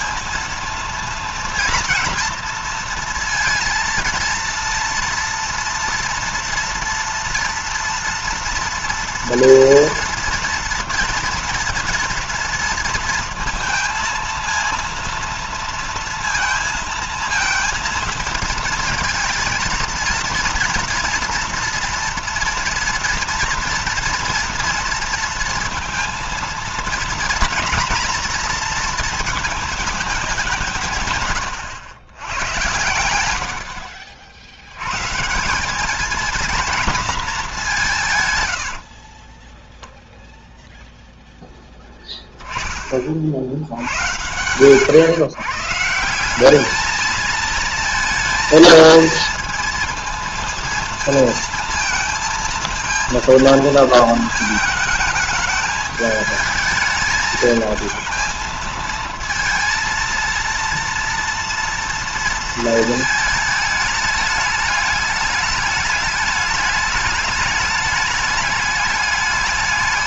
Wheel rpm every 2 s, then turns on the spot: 230, 230, 230, 230, 230, 230, 230, 230, 230, 230, 230, 230, 230, 230, 230, 160, 90, 130, 230, 50, 0, 30, 120, 210, 230, 220, 230, 220, 220, 220, 230, 230, 210, 210, 200.
38-40